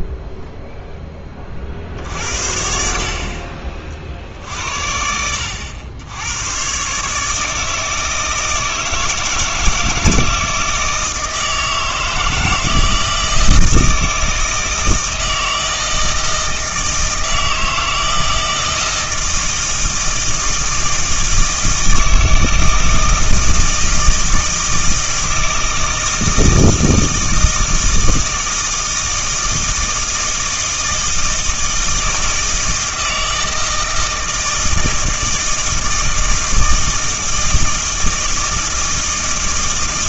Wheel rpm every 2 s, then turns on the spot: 0, 50, 70, 130, 160, 160, 160, 160, 160, 160, 160, 160, 160, 160, 160, 160, 160, 160, 160, 160.
none